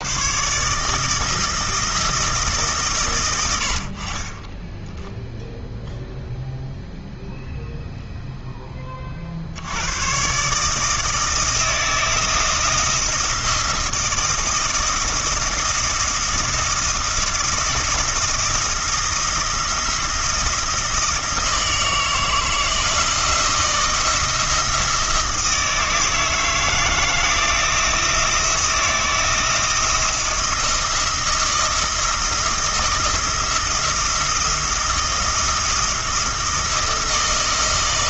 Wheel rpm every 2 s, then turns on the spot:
150, 140, 20, 0, 30, 160, 170, 160, 170, 170, 160, 160, 160, 160, 170, 170, 170, 170, 170.
none